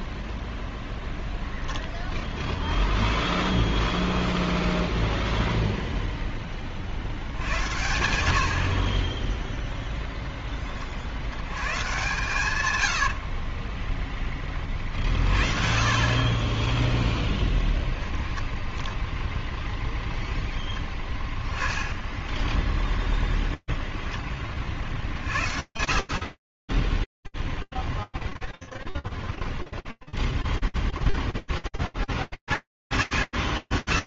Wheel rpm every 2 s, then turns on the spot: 0, 0, 0, 0, 80, 0, 130, 20, 30, 10, 0, 10, 10, 50, 0, 0, 20.
16-20 22-24